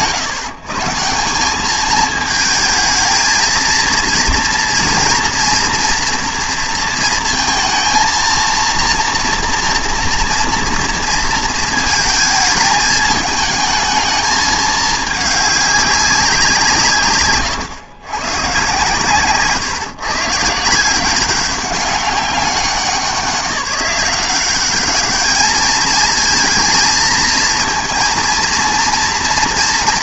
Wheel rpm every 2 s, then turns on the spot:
140, 220, 230, 230, 230, 230, 220, 210, 180, 130, 170, 190, 200, 230, 230.
none